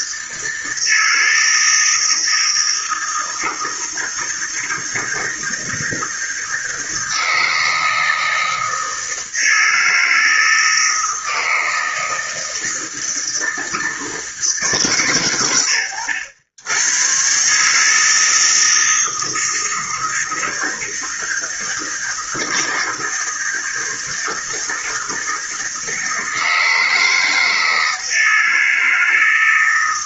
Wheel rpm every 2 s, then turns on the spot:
160, 160, 160, 160, 160, 160, 160, 140, 100, 160, 160, 160, 160, 160, 160.
none